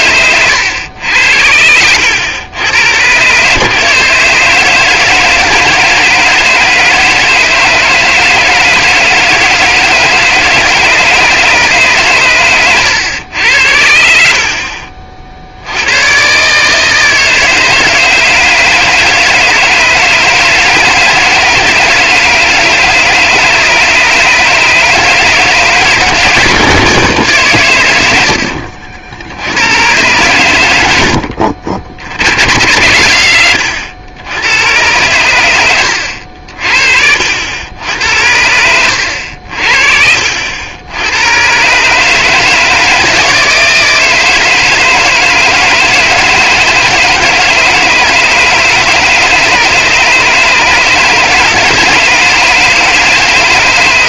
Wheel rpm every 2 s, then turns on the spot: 100, 100, 160, 160, 160, 160, 110, 50, 150, 160, 160, 150, 150, 160, 60, 100, 80, 100, 60, 90, 80, 160, 160, 160, 150, 150, 160.
28-30 38-40